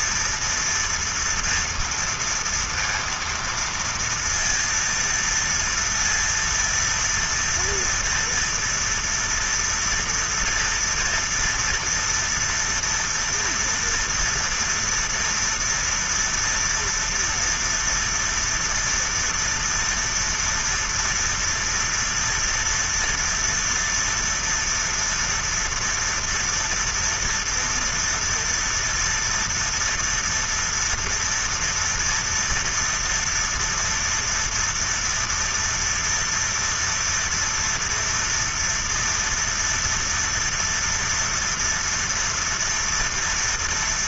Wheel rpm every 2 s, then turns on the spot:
240, 230, 230, 230, 230, 240, 230, 230, 230, 230, 230, 230, 230, 240, 230, 230, 230, 230, 230, 230, 230, 230.
none